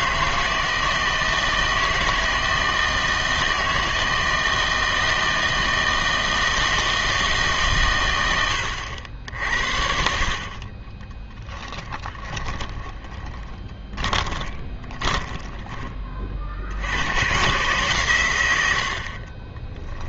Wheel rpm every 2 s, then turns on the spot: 160, 160, 160, 160, 90, 30, 20, 20, 60, 90.
10-16